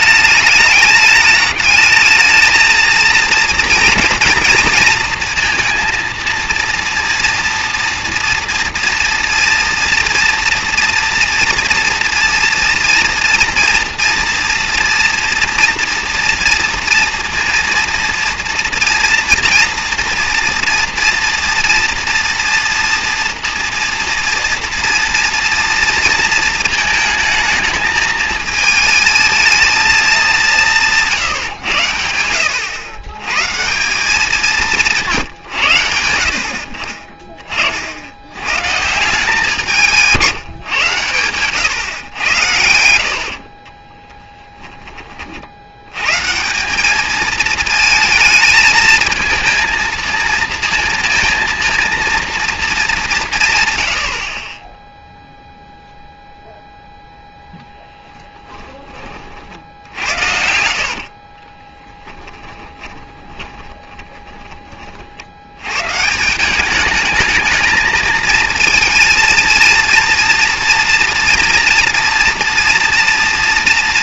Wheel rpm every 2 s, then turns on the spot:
210, 220, 230, 230, 230, 230, 230, 230, 230, 230, 240, 230, 240, 230, 220, 170, 100, 180, 40, 150, 130, 80, 10, 180, 220, 230, 220, 10, 0, 20, 60, 20, 30, 200, 230, 240, 240.
42-44 60-64